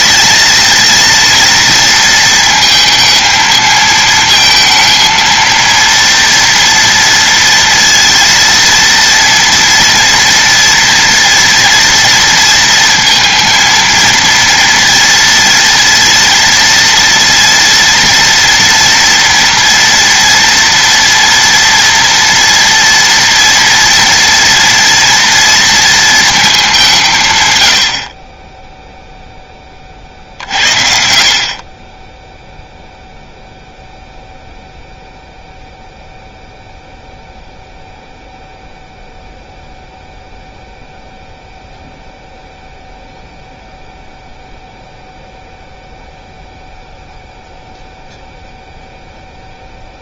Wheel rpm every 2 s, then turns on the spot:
230, 220, 220, 230, 230, 240, 230, 230, 230, 230, 240, 230, 230, 190, 10, 60, 0, 0, 0, 0, 0, 0, 0, 0, 0.
none